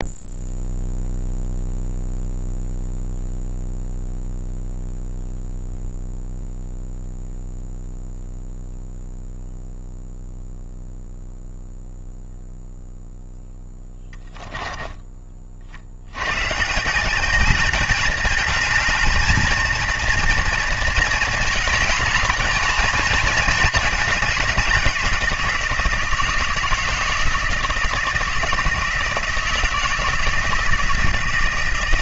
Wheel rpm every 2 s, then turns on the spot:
0, 0, 0, 0, 0, 0, 0, 10, 120, 220, 230, 220, 200, 160, 160, 160.
14-16